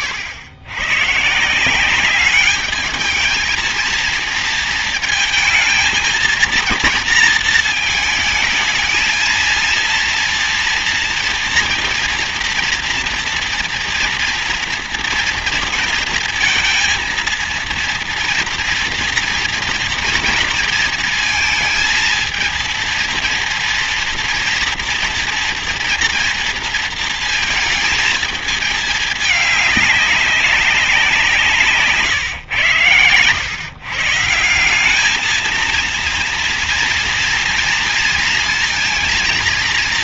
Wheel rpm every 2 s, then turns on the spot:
110, 210, 220, 230, 220, 230, 230, 230, 230, 230, 230, 230, 230, 230, 220, 190, 120, 180, 230, 230.
none